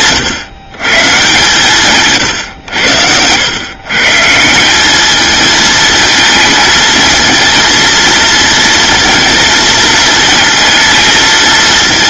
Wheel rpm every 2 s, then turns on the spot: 140, 90, 210, 220, 230, 230.
none